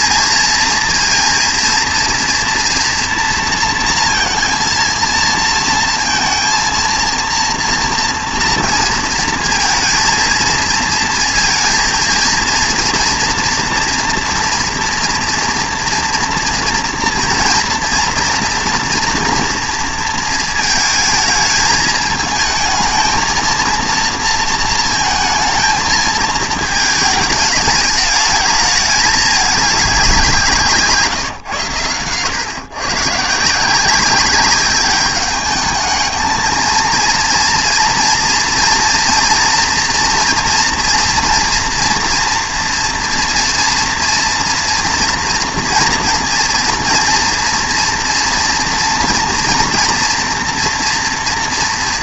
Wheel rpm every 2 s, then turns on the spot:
230, 230, 230, 230, 230, 230, 230, 230, 230, 240, 220, 220, 230, 220, 210, 160, 120, 200, 220, 230, 230, 230, 240, 230, 230, 230.
none